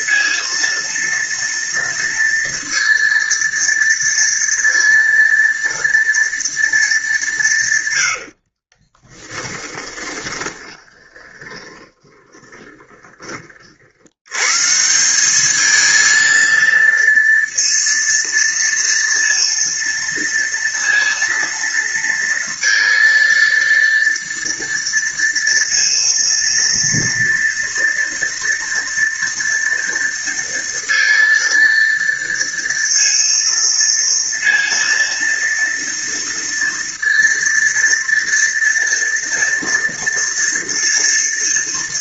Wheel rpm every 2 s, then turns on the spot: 230, 230, 230, 220, 30, 20, 20, 160, 230, 230, 230, 230, 230, 230, 230, 230, 230, 230, 230, 230, 230.
8-14